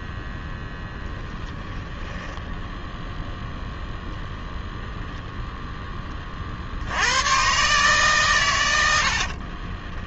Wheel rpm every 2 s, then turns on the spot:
10, 10, 0, 50, 100.
none